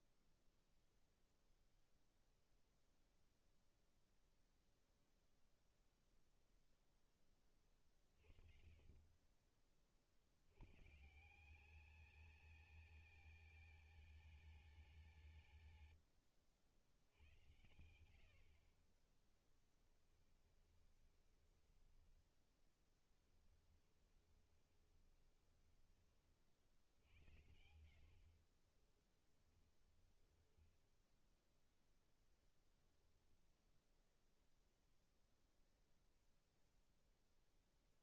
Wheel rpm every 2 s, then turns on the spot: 0, 0, 0, 10, 30, 150, 220, 190, 80, 40, 20, 10, 20, 80, 20, 10, 0, 0, 0.
18-26 28-32